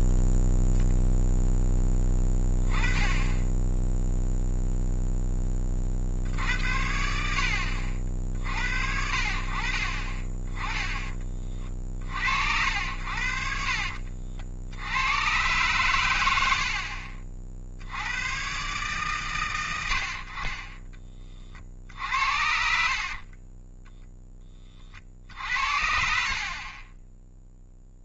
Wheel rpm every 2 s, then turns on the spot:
0, 10, 0, 50, 80, 20, 80, 90, 60, 130, 30, 40, 50, 20.
22-24